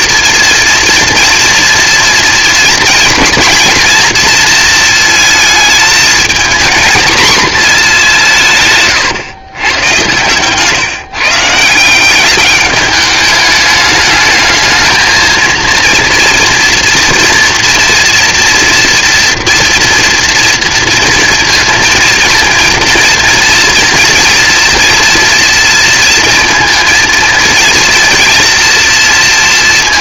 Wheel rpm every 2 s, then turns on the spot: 230, 230, 230, 230, 150, 140, 200, 220, 230, 230, 230, 230, 230, 230, 230.
none